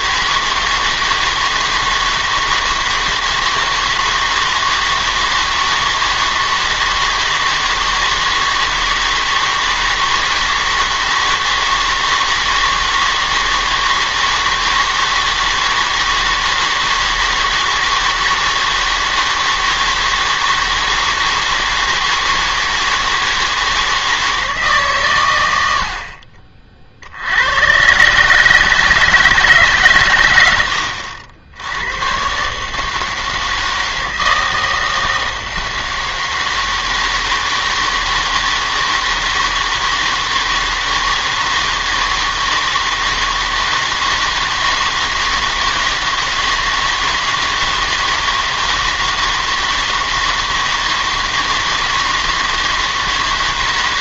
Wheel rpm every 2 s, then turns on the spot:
160, 160, 160, 160, 160, 160, 160, 160, 160, 160, 160, 160, 150, 40, 150, 90, 150, 160, 160, 160, 160, 160, 160, 160, 160, 160, 160.
none